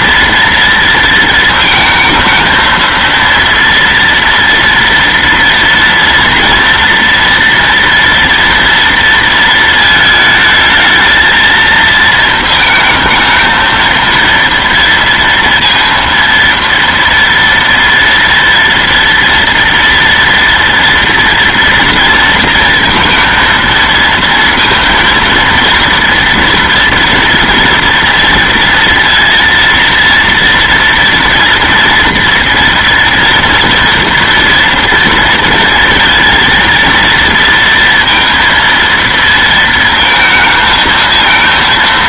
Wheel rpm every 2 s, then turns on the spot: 230, 220, 230, 230, 230, 220, 230, 230, 230, 230, 230, 230, 230, 240, 230, 230, 230, 230, 230, 230, 220.
none